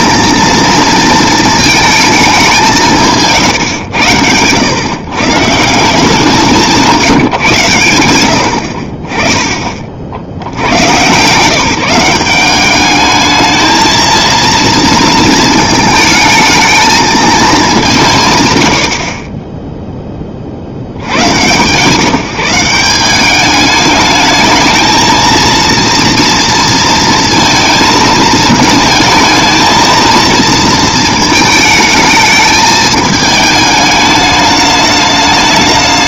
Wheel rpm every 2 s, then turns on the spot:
230, 160, 110, 170, 60, 100, 200, 230, 220, 100, 80, 180, 220, 230, 220, 230, 220, 210.
none